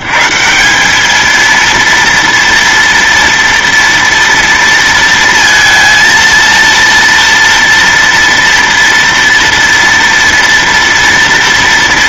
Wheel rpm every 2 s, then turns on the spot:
150, 230, 230, 230, 230, 230.
none